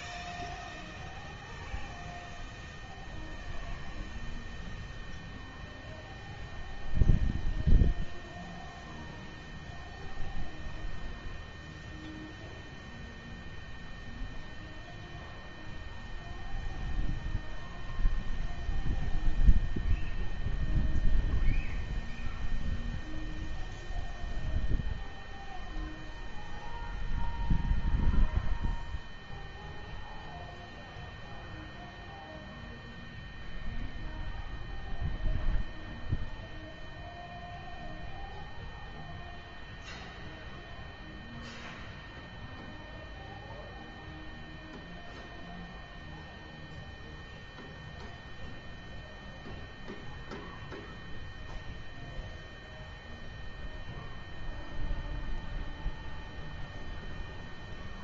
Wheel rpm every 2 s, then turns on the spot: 0, 0, 0, 0, 0, 0, 0, 0, 0, 0, 0, 0, 0, 0, 0, 0, 0, 0, 0, 0, 0, 0, 0, 0, 0, 0, 0, 0, 0.
none